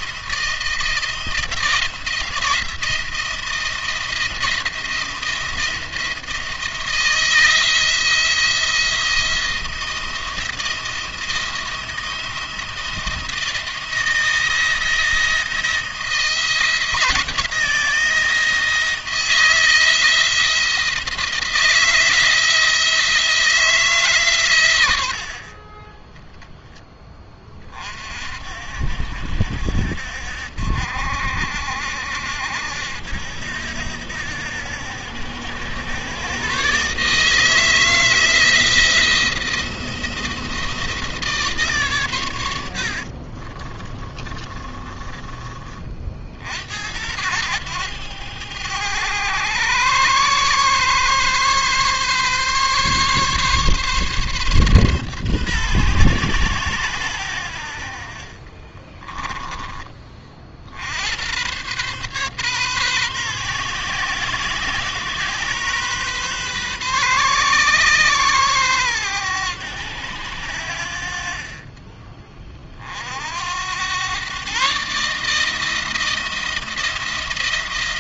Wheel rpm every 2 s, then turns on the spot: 170, 170, 170, 170, 170, 170, 170, 170, 170, 170, 170, 170, 110, 10, 50, 60, 70, 80, 130, 170, 160, 70, 30, 70, 100, 130, 140, 140, 120, 30, 60, 130, 130, 130, 120, 80, 40, 140, 170.
42-46 58-60